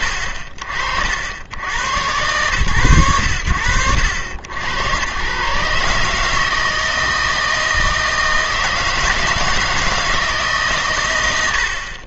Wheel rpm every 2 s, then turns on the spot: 60, 90, 90, 160, 160, 140.
none